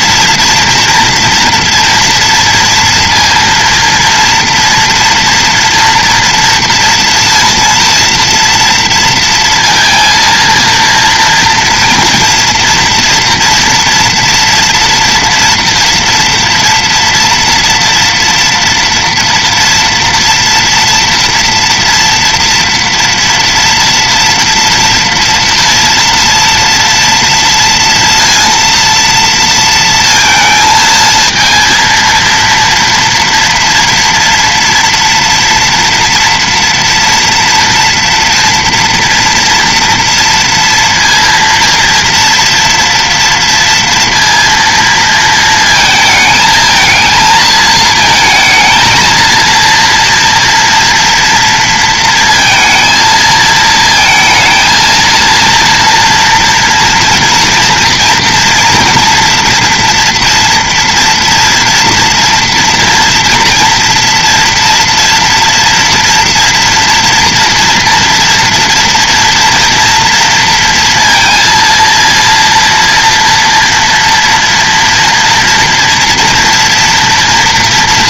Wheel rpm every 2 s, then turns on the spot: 230, 230, 230, 230, 230, 230, 230, 230, 230, 230, 230, 230, 230, 230, 230, 220, 230, 230, 230, 230, 230, 230, 230, 220, 230, 230, 220, 230, 230, 240, 240, 230, 230, 230, 230, 230, 230, 230, 240.
none